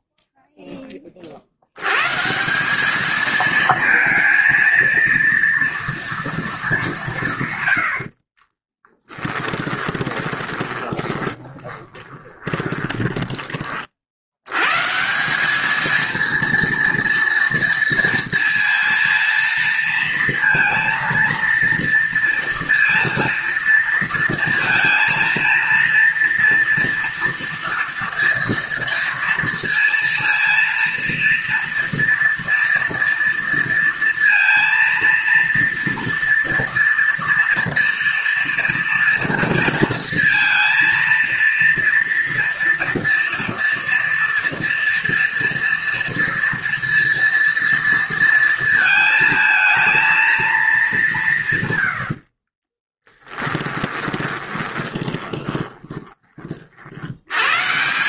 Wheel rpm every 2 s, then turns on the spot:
0, 170, 230, 210, 30, 20, 10, 110, 230, 230, 230, 230, 230, 230, 230, 230, 230, 230, 230, 230, 230, 230, 230, 230, 220, 210, 30, 20, 40.
8-14 52-56